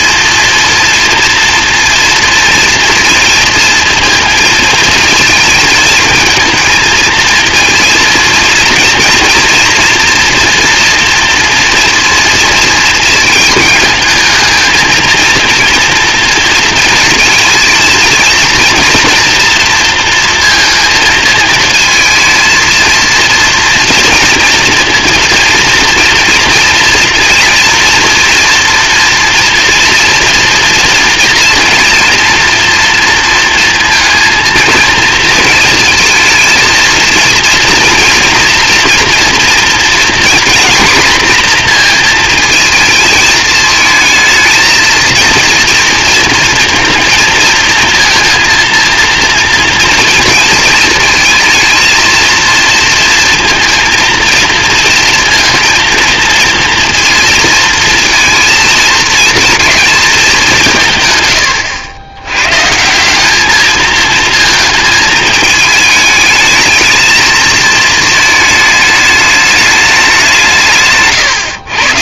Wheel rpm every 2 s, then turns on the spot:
230, 230, 220, 230, 230, 230, 230, 220, 230, 230, 230, 230, 230, 230, 230, 230, 230, 230, 230, 240, 240, 220, 230, 230, 230, 230, 230, 230, 230, 220, 180, 140, 220, 220, 220, 160.
none